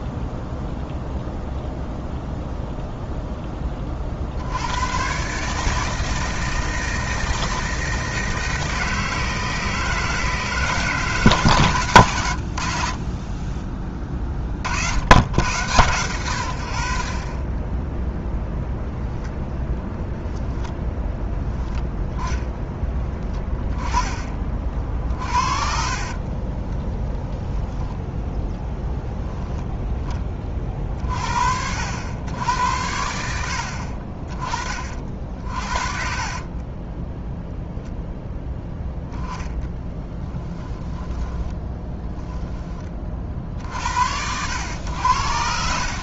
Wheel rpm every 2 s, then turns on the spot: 0, 0, 80, 160, 160, 150, 80, 40, 100, 0, 0, 10, 30, 30, 10, 30, 90, 40, 30, 0, 10, 10, 90.
26-28 36-38 40-42